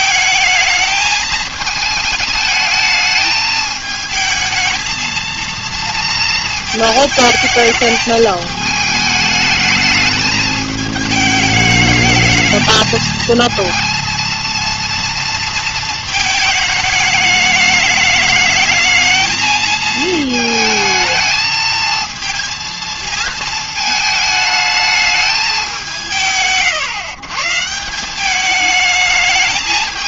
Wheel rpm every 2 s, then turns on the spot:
210, 210, 230, 220, 210, 210, 220, 230, 210, 220, 220, 220, 220, 130, 210.
none